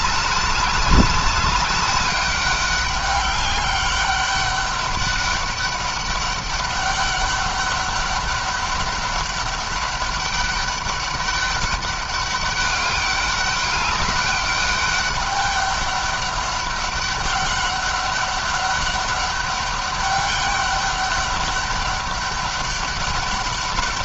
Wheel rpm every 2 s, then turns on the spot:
200, 200, 200, 200, 200, 200, 200, 200, 200, 200, 200, 200.
none